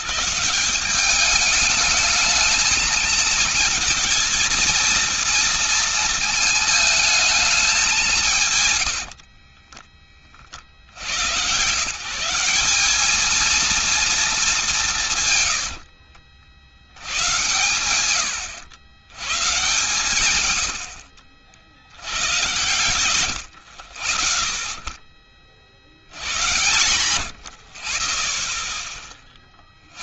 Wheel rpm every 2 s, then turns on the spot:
120, 210, 230, 220, 170, 60, 180, 220, 60, 90, 120, 110, 30, 100, 30.
22-24 26-28